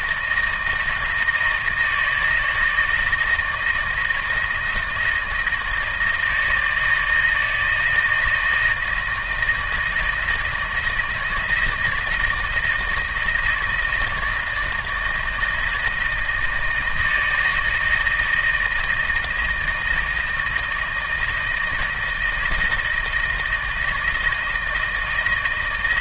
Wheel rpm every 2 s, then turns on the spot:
160, 160, 170, 160, 160, 160, 160, 160, 160, 160, 160, 160, 160.
none